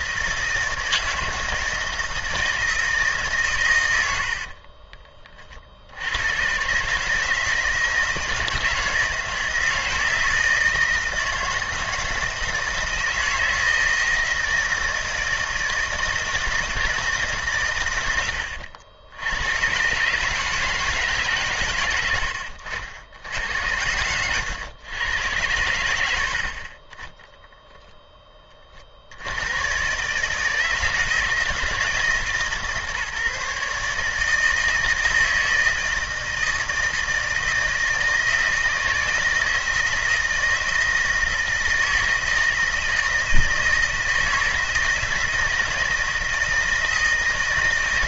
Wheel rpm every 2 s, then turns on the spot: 160, 150, 30, 140, 170, 160, 160, 160, 160, 80, 150, 80, 110, 30, 60, 160, 150, 160, 160, 160, 160, 160, 160, 170.
4-6